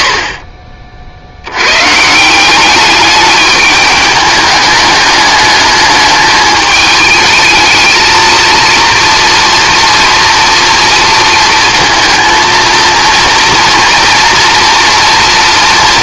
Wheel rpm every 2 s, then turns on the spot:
50, 200, 210, 210, 230, 230, 230, 230.
none